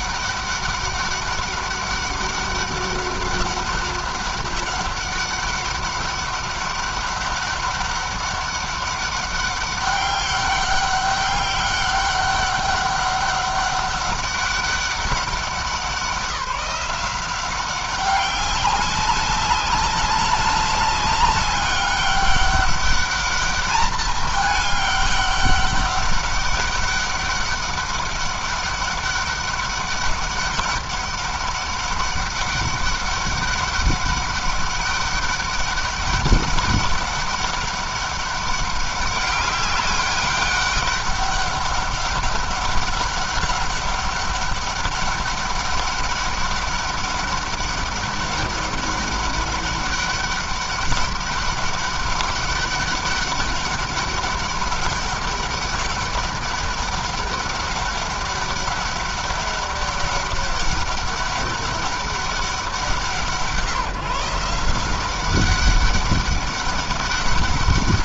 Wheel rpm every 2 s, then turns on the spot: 200, 200, 200, 200, 200, 200, 200, 190, 180, 200, 200, 200, 200, 200, 200, 200, 200, 200, 200, 200, 200, 200, 200, 200, 200, 200, 200, 200, 200, 200, 200, 180, 170, 200.
none